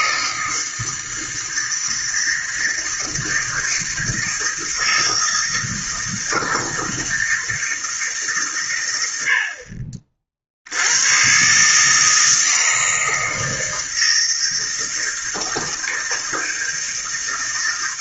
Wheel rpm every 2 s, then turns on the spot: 160, 160, 160, 160, 100, 80, 160, 160, 160.
none